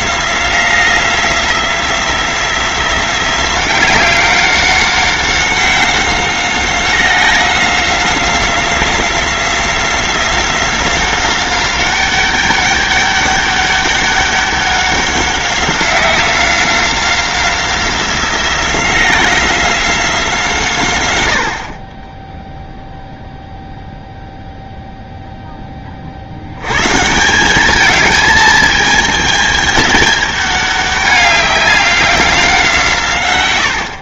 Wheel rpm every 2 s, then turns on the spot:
180, 180, 190, 180, 180, 180, 200, 200, 180, 180, 140, 0, 0, 120, 220, 200, 150.
none